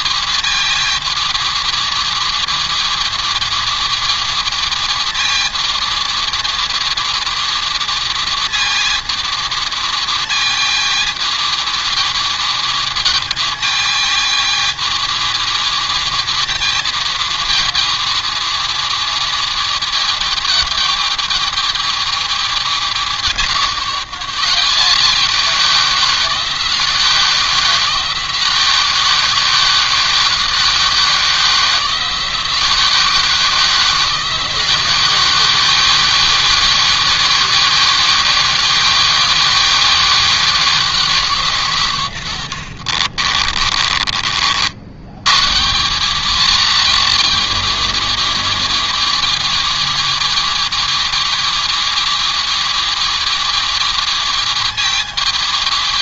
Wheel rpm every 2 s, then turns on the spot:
230, 220, 230, 230, 220, 220, 220, 220, 220, 220, 220, 200, 180, 170, 170, 170, 170, 170, 170, 180, 170, 80, 70, 210, 220, 220, 220, 220.
42-44